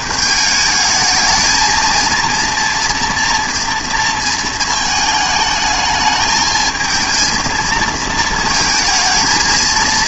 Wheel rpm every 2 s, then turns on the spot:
210, 230, 220, 220, 220.
none